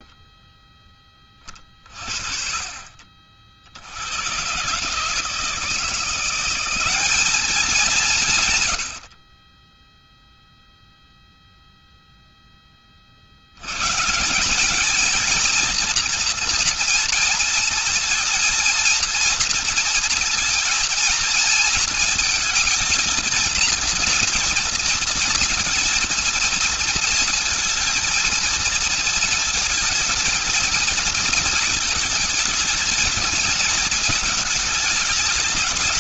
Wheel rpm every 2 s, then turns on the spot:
0, 30, 120, 180, 130, 0, 0, 170, 240, 230, 230, 220, 230, 230, 230, 220, 220, 210.
none